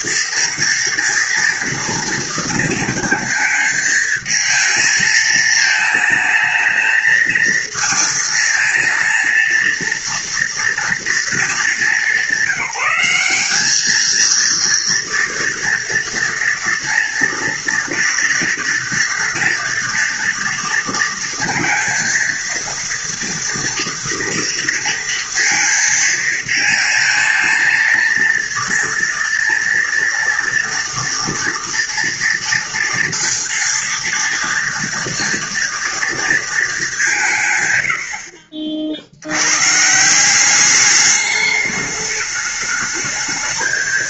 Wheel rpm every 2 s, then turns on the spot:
230, 230, 220, 220, 230, 230, 190, 230, 230, 230, 230, 230, 230, 230, 230, 230, 230, 230, 210, 50, 200, 210.
none